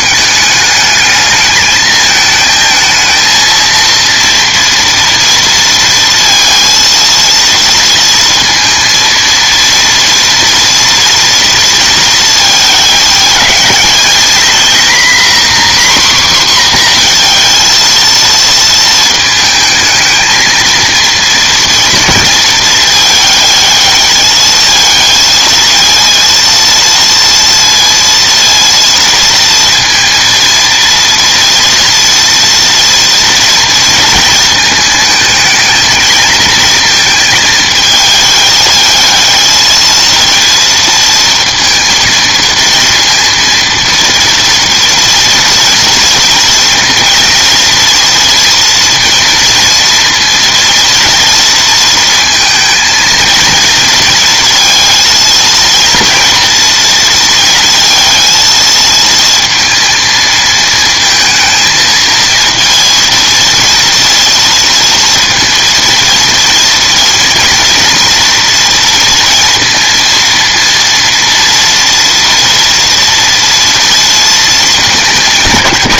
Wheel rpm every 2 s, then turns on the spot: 210, 220, 230, 230, 230, 230, 210, 230, 250, 230, 230, 220, 220, 230, 230, 230, 230, 220, 220, 220, 230, 230, 230, 230, 230, 230, 230, 230, 230, 230, 220, 230, 230, 230, 230, 230, 230, 220.
none